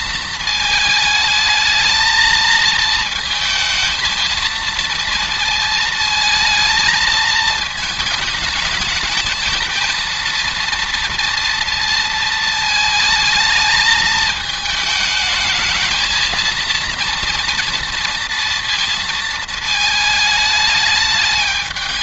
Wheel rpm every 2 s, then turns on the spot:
220, 220, 220, 220, 220, 230, 220, 220, 230, 230, 220.
none